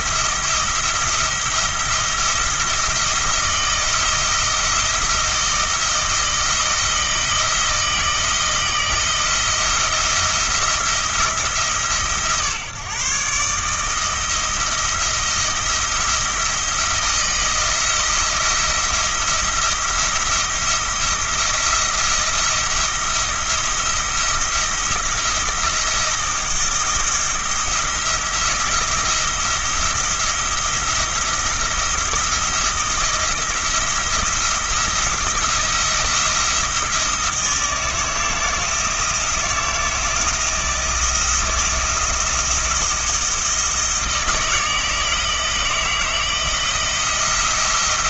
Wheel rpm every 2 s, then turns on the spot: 170, 170, 170, 160, 170, 170, 140, 160, 170, 170, 170, 170, 170, 170, 170, 170, 160, 170, 170, 170, 170, 160, 160, 170.
none